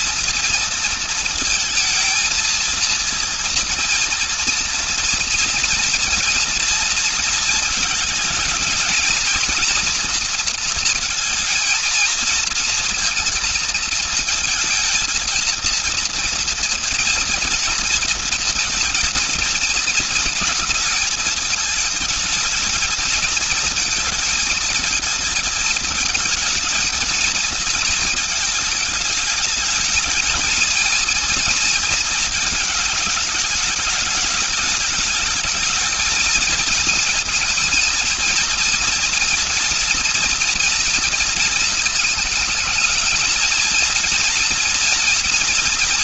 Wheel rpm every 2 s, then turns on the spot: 230, 230, 230, 230, 220, 230, 230, 230, 230, 230, 230, 220, 220, 220, 210, 230, 210, 210, 220, 230, 230, 220, 230.
none